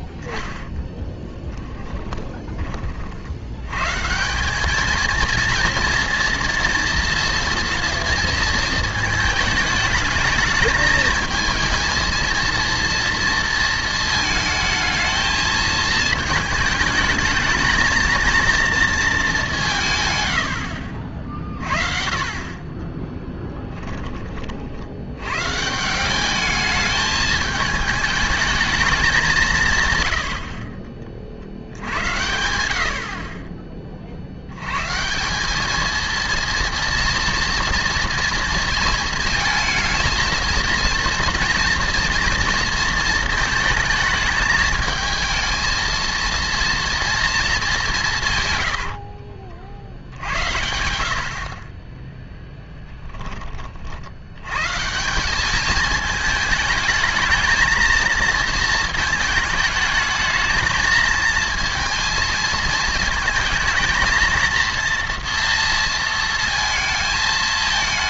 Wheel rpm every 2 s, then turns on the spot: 10, 30, 200, 230, 220, 220, 230, 220, 220, 230, 70, 20, 60, 210, 220, 50, 70, 110, 230, 230, 220, 230, 220, 230, 70, 80, 10, 120, 220, 220, 220, 220, 230, 230.
20-22 48-50